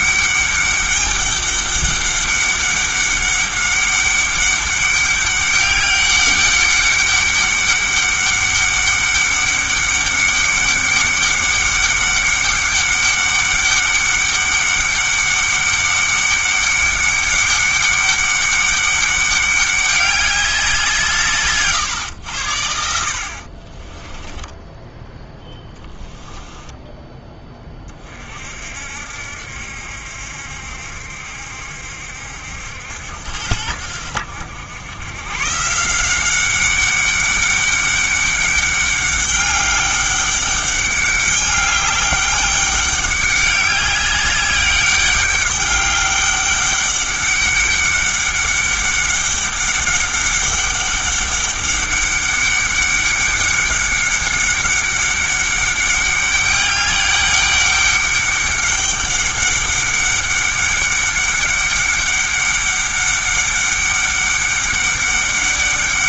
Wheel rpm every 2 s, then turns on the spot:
200, 200, 200, 200, 200, 200, 200, 200, 200, 200, 180, 70, 10, 10, 60, 70, 80, 100, 200, 200, 200, 200, 200, 200, 200, 200, 200, 200, 200, 200, 200, 200, 200.
24-26